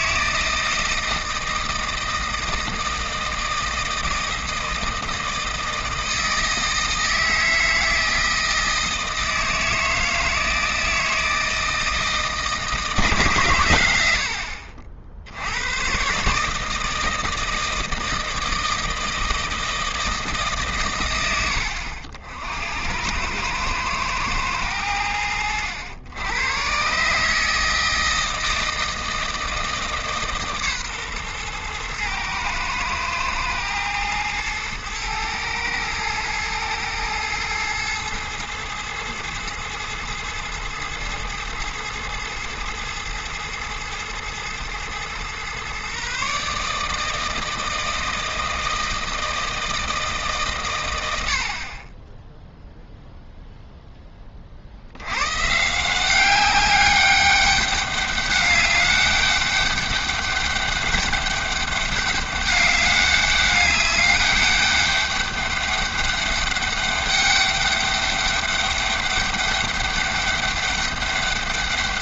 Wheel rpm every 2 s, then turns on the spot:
160, 160, 160, 160, 160, 160, 150, 60, 150, 160, 140, 80, 100, 120, 160, 140, 110, 110, 110, 110, 110, 110, 110, 150, 160, 130, 0, 60, 200, 200, 200, 200, 200, 200, 200, 200.
none